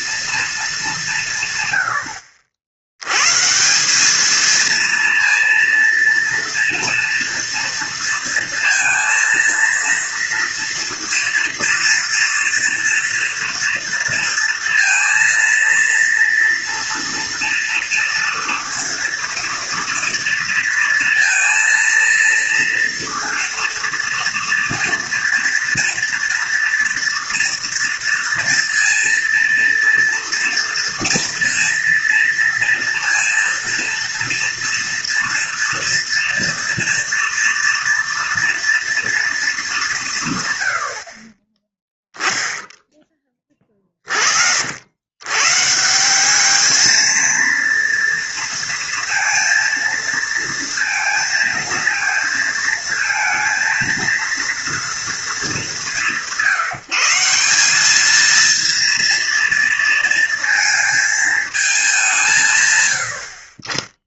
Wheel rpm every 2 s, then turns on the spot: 200, 90, 230, 230, 230, 230, 240, 230, 230, 230, 230, 230, 230, 230, 230, 230, 230, 230, 230, 240, 80, 10, 80, 220, 230, 230, 230, 230, 160, 230, 230, 100.
none